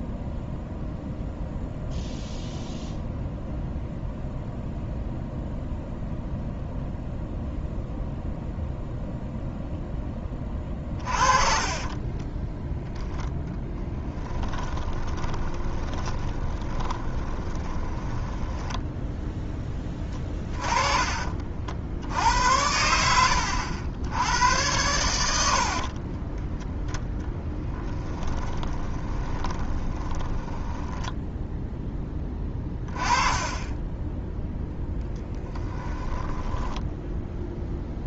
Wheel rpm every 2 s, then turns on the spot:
0, 0, 0, 0, 0, 30, 10, 20, 20, 10, 20, 80, 100, 10, 30, 10, 20, 10, 10.
10-12 14-20 28-32 36-38